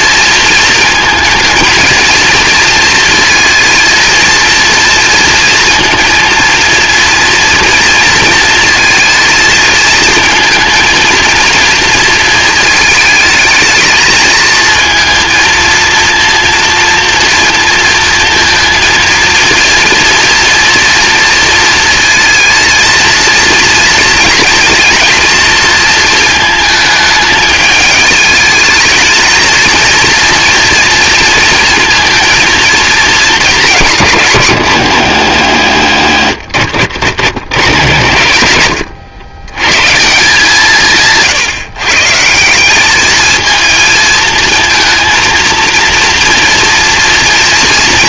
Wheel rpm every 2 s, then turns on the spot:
220, 230, 230, 230, 230, 230, 220, 230, 230, 230, 240, 230, 230, 220, 230, 230, 220, 110, 70, 80, 160, 210, 230, 230.
none